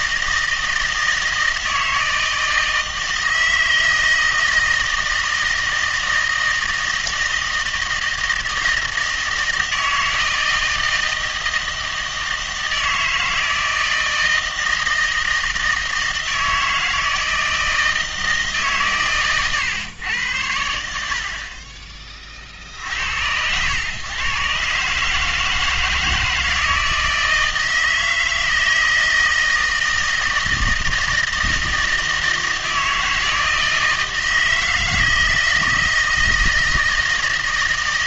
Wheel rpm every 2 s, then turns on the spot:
160, 160, 160, 160, 160, 160, 160, 160, 160, 140, 80, 70, 140, 160, 160, 160, 160, 160, 160.
none